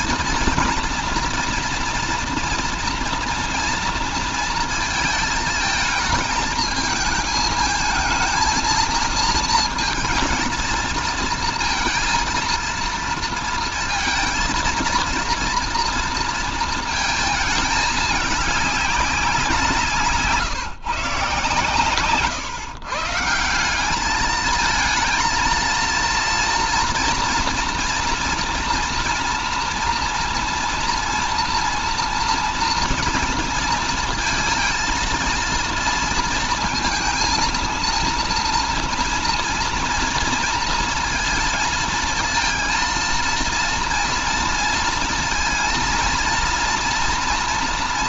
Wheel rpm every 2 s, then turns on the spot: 230, 230, 230, 220, 220, 230, 230, 230, 230, 210, 150, 150, 220, 230, 230, 230, 230, 230, 230, 230, 230, 230, 230, 240.
none